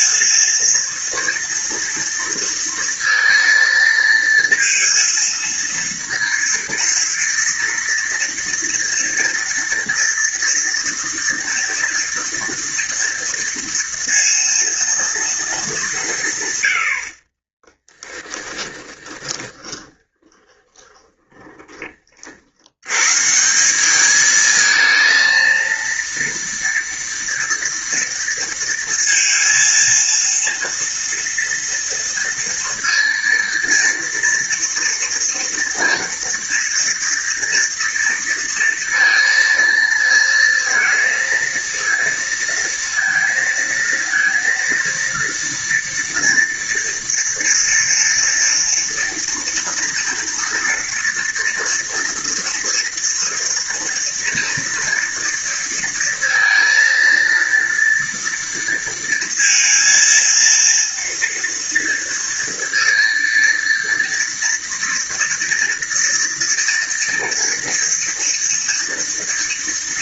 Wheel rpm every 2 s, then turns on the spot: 230, 230, 230, 230, 230, 240, 230, 230, 170, 10, 30, 60, 210, 230, 230, 230, 230, 230, 230, 230, 230, 230, 230, 230, 230, 230, 230, 230, 230, 230, 230, 230, 230, 230, 230.
18-22